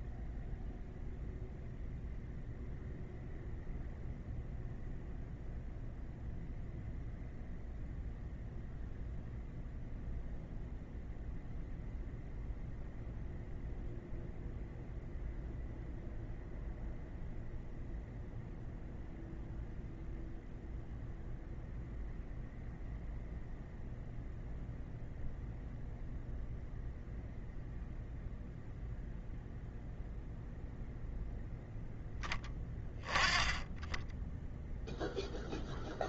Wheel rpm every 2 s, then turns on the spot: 0, 0, 0, 0, 0, 0, 0, 0, 0, 0, 0, 0, 0, 0, 0, 0, 10, 0.
none